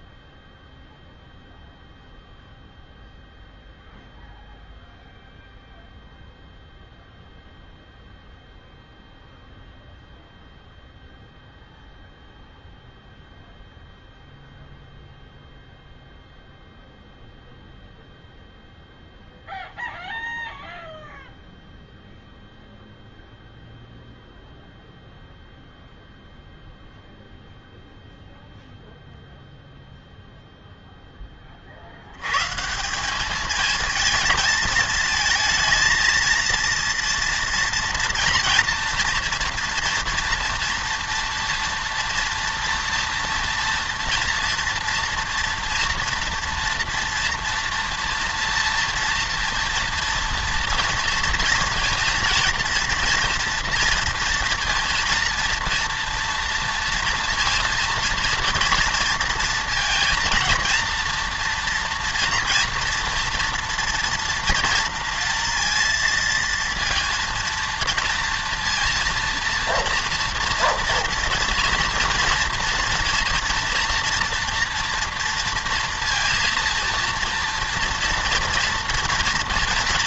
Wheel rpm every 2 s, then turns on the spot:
0, 0, 0, 0, 0, 0, 0, 0, 0, 0, 0, 0, 0, 0, 0, 0, 150, 220, 230, 240, 240, 230, 230, 230, 240, 230, 230, 230, 230, 230, 230, 230, 230, 230, 230, 230, 230, 230, 230, 230.
none